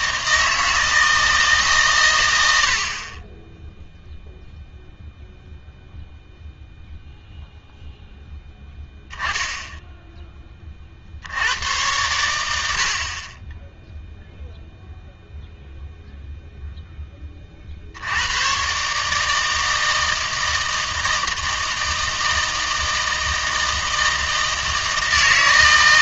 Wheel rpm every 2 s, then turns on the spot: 160, 70, 0, 0, 10, 40, 70, 0, 0, 140, 160, 160, 160.
none